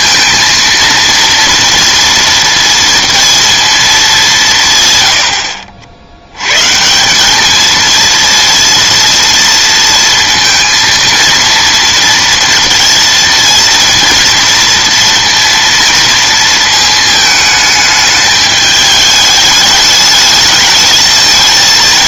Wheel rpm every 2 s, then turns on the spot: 230, 230, 150, 140, 230, 230, 230, 230, 230, 210, 220.
none